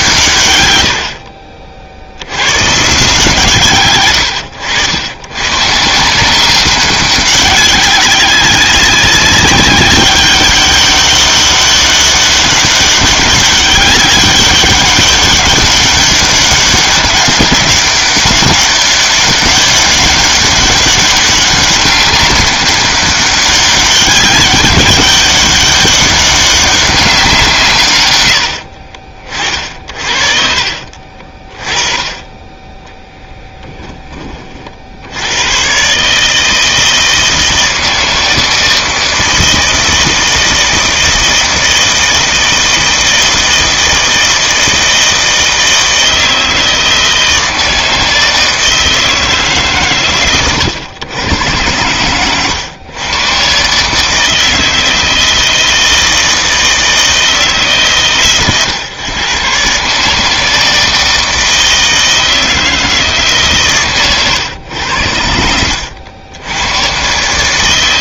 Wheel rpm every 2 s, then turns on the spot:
110, 140, 90, 190, 190, 200, 200, 200, 200, 200, 200, 200, 200, 200, 50, 50, 10, 60, 160, 160, 160, 160, 160, 160, 160, 110, 110, 160, 160, 120, 160, 160, 100, 100.
30-32